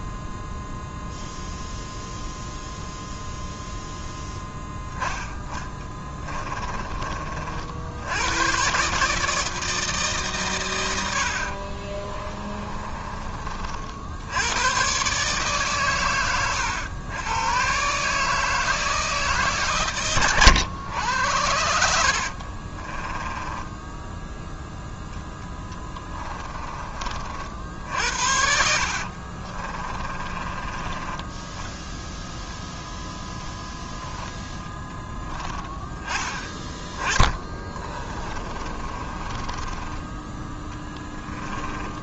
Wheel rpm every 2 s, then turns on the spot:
0, 0, 10, 30, 140, 100, 30, 110, 100, 160, 100, 40, 0, 30, 60, 20, 0, 10, 20, 30, 10.
12-14 22-24 28-30 38-42